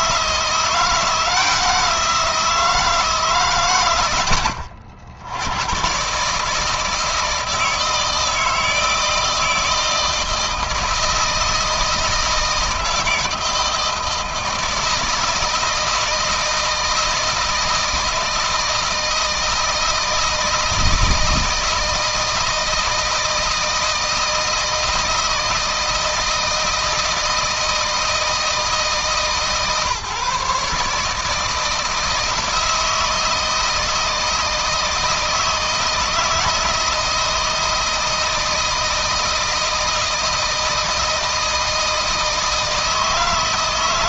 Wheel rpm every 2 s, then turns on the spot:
170, 160, 80, 160, 160, 160, 160, 160, 160, 160, 160, 160, 160, 160, 160, 150, 160, 160, 170, 160, 160, 160.
none